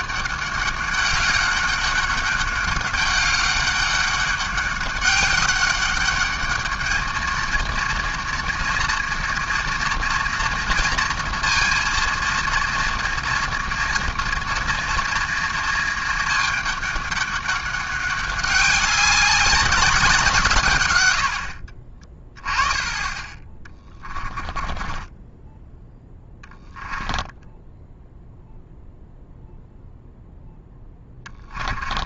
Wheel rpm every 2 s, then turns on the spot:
200, 200, 200, 210, 230, 230, 230, 230, 210, 200, 130, 20, 20, 10, 0, 10.
24-28 30-32